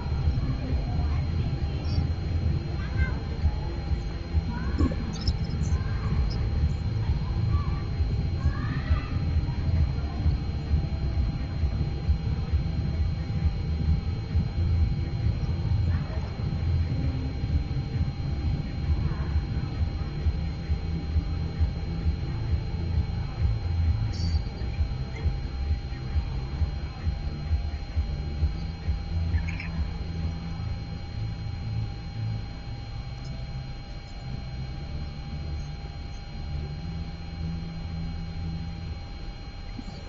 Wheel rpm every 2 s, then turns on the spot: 0, 0, 0, 0, 0, 0, 0, 0, 0, 0, 0, 0, 0, 0, 0, 0, 0, 0, 0, 0.
none